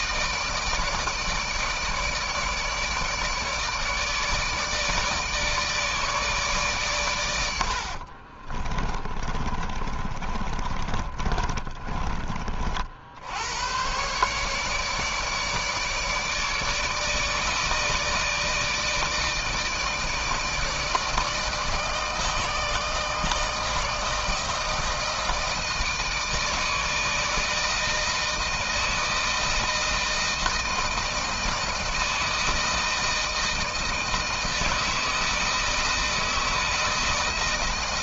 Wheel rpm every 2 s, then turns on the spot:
160, 150, 160, 120, 20, 30, 60, 150, 150, 160, 160, 160, 160, 160, 160, 160, 160, 160, 160.
8-12